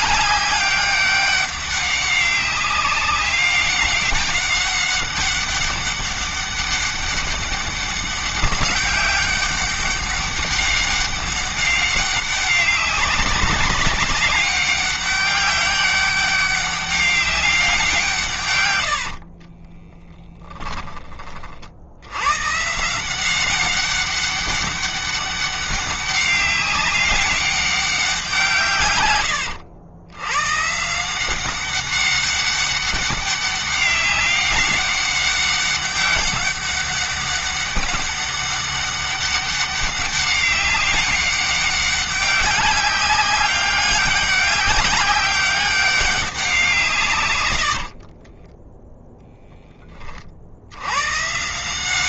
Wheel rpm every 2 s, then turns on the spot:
200, 200, 200, 200, 200, 200, 190, 200, 200, 100, 20, 150, 200, 200, 110, 160, 200, 200, 200, 200, 200, 200, 200, 150, 10, 90.
18-20